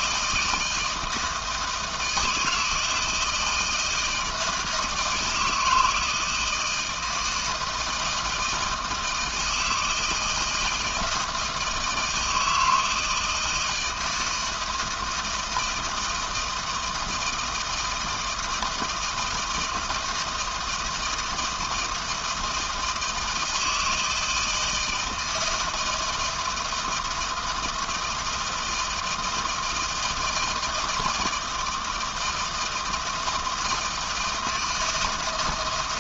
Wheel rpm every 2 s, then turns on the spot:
160, 160, 160, 160, 160, 160, 160, 160, 160, 160, 160, 160, 160, 160, 170, 160, 160, 160.
none